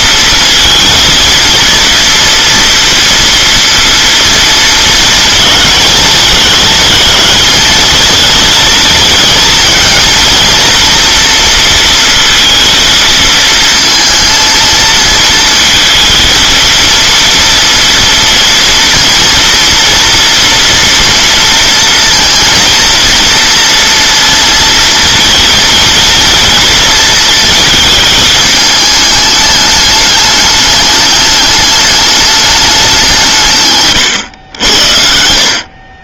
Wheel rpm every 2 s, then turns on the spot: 230, 230, 230, 220, 230, 230, 230, 230, 230, 230, 230, 230, 230, 230, 210, 210, 200, 80.
none